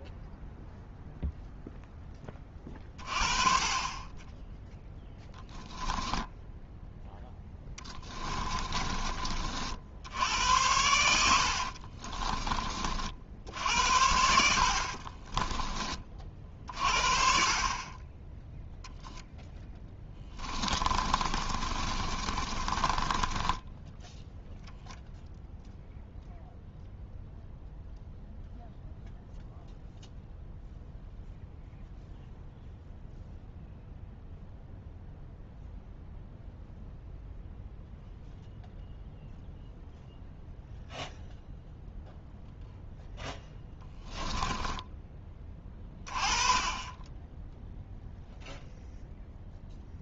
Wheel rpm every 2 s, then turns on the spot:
0, 30, 0, 0, 30, 80, 50, 50, 40, 0, 30, 20, 0, 0, 0, 0, 0, 0, 0, 0, 0, 0, 10, 10, 0.
8-12 14-16 20-24 44-46